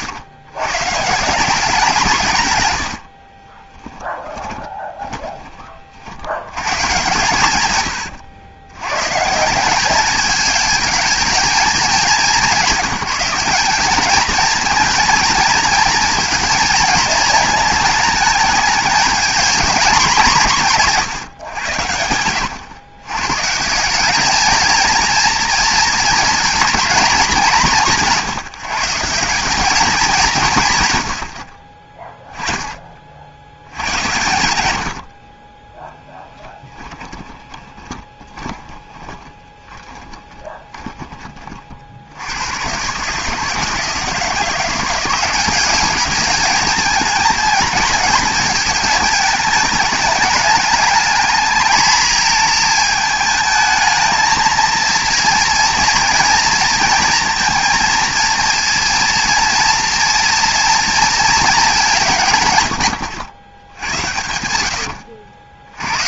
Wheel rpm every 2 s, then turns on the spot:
120, 90, 20, 110, 100, 220, 200, 230, 230, 220, 170, 110, 220, 220, 160, 150, 30, 80, 10, 30, 20, 120, 180, 210, 220, 220, 220, 220, 230, 230, 230, 130, 90.
2-6 34-42 64-66